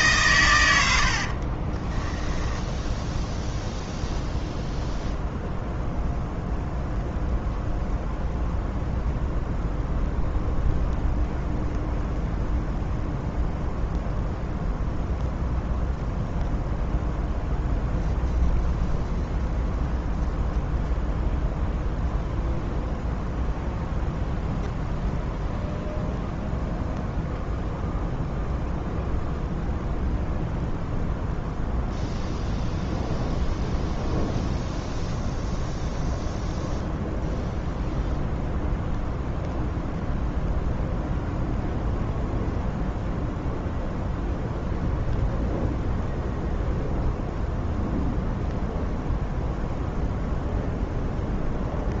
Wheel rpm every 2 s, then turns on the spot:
100, 0, 0, 0, 0, 0, 0, 0, 0, 0, 0, 0, 0, 0, 0, 0, 0, 0, 0, 0, 0, 0, 0, 0, 0, 0.
none